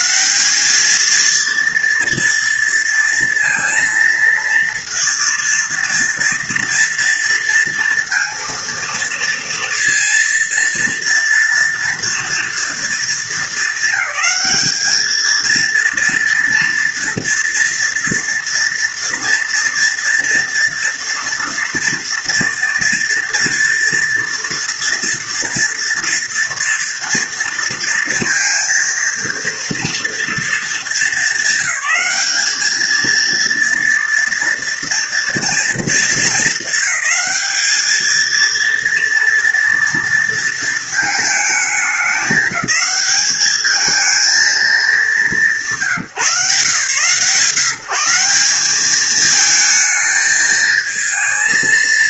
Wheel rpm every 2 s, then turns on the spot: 200, 230, 230, 230, 230, 230, 230, 220, 230, 230, 230, 230, 230, 230, 230, 230, 220, 230, 200, 230, 230, 190, 220, 140, 190, 220.
none